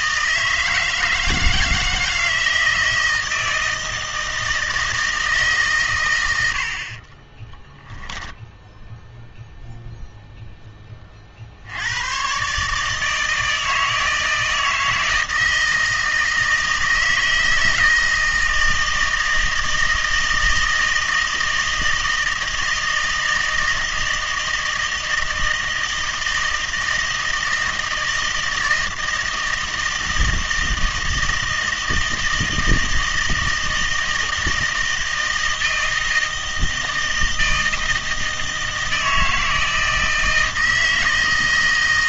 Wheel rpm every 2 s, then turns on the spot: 160, 160, 160, 70, 0, 10, 140, 160, 160, 160, 160, 160, 160, 160, 160, 160, 160, 160, 160, 160, 160.
none